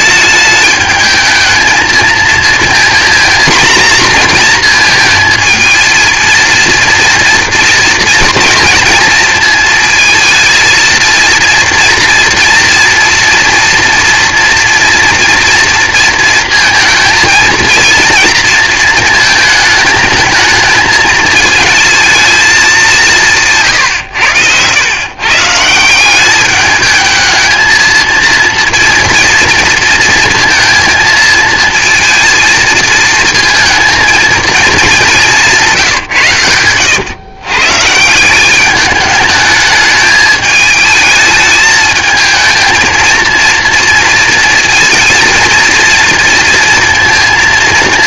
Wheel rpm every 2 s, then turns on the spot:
210, 230, 230, 230, 230, 220, 230, 230, 230, 230, 220, 220, 100, 200, 230, 230, 220, 220, 110, 190, 220, 220, 230, 230.
none